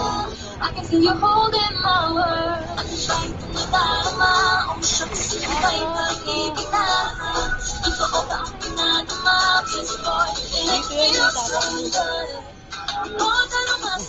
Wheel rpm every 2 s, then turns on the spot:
0, 0, 0, 0, 0, 0, 0.
none